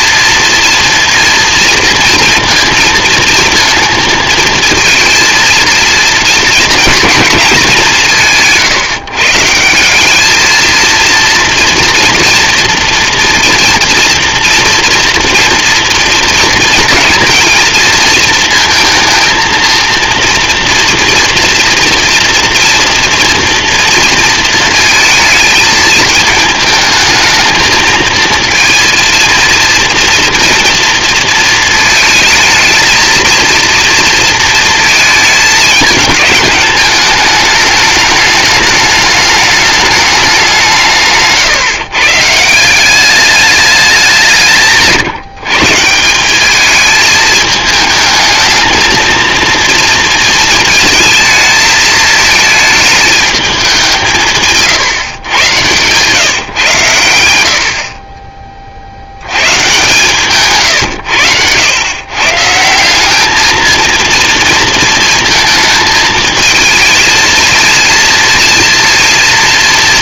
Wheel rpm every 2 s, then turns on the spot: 230, 230, 220, 220, 160, 220, 230, 230, 240, 230, 230, 230, 230, 220, 230, 230, 220, 230, 210, 210, 190, 170, 170, 200, 220, 230, 220, 150, 140, 30, 130, 150, 230, 220, 230.
none